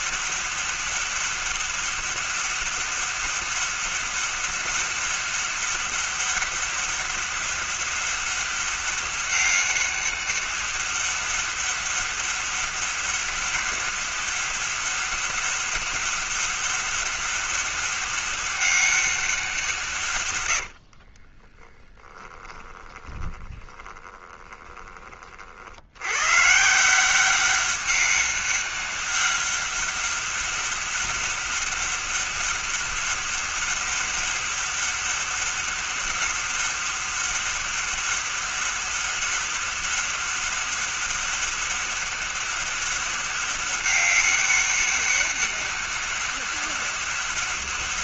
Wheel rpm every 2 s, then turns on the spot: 200, 200, 200, 200, 200, 200, 200, 190, 200, 200, 70, 30, 20, 150, 200, 200, 200, 200, 200, 200, 200, 200, 200, 200.
20-26